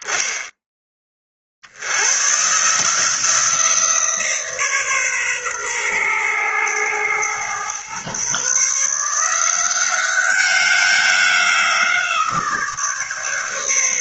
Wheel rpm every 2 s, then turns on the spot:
10, 140, 150, 110, 140, 190, 160.
none